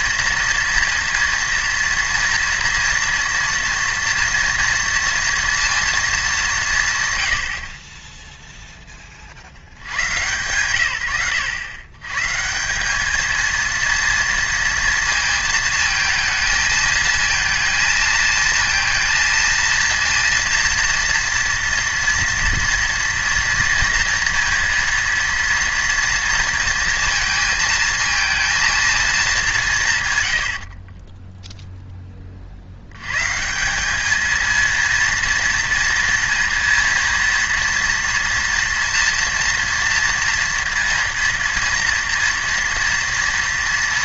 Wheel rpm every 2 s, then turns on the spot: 230, 230, 230, 170, 10, 110, 180, 230, 230, 230, 230, 230, 230, 230, 230, 40, 70, 230, 230, 230, 230, 230.
30-32